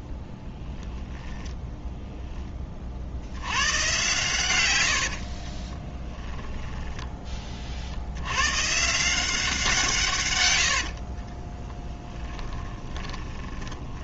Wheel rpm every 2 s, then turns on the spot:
10, 30, 120, 10, 120, 90, 10.
4-8 10-14